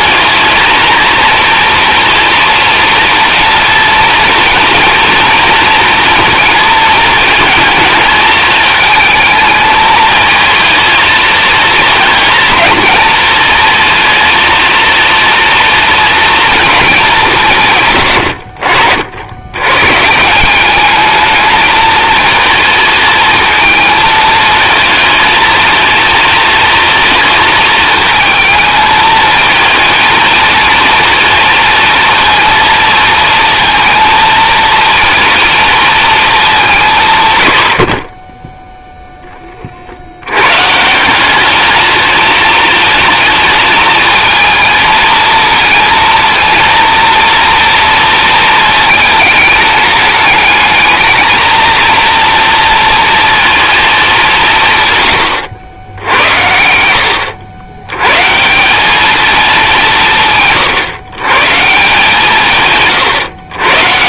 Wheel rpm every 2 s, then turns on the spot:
230, 230, 230, 220, 220, 220, 230, 230, 220, 60, 200, 220, 230, 230, 220, 230, 230, 230, 200, 0, 160, 220, 220, 230, 220, 220, 230, 140, 80, 190, 140, 140.
none